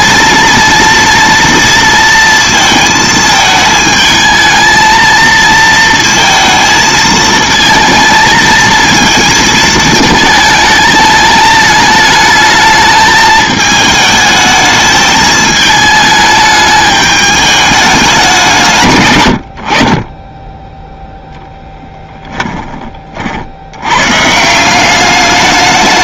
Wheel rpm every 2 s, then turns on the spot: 230, 230, 220, 220, 230, 220, 220, 220, 210, 150, 10, 20, 180.
none